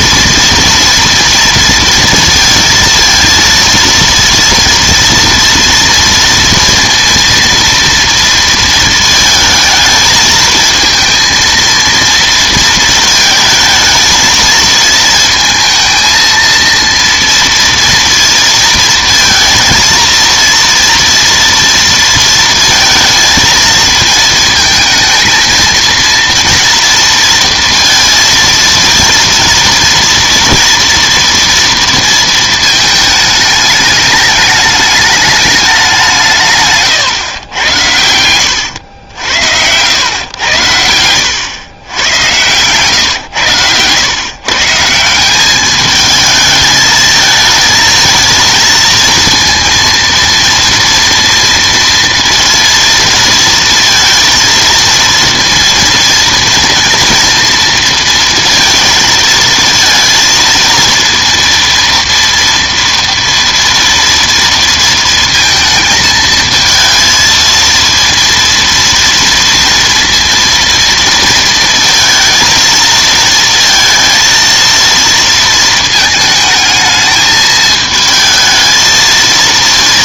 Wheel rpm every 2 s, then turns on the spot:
230, 230, 230, 230, 230, 220, 230, 220, 230, 230, 230, 230, 220, 230, 230, 230, 230, 210, 150, 90, 100, 130, 140, 220, 230, 230, 230, 230, 230, 230, 230, 230, 230, 220, 230, 230, 230, 230, 220, 220.
none